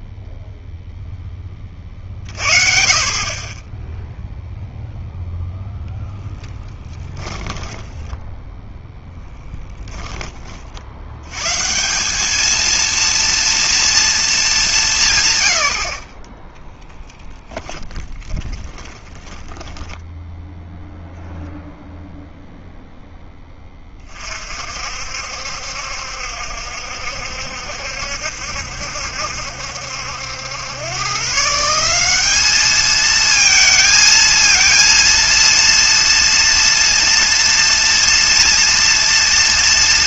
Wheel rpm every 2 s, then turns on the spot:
0, 40, 0, 10, 10, 50, 220, 190, 10, 20, 0, 0, 50, 70, 70, 100, 210, 230, 230, 230.
6-10 16-20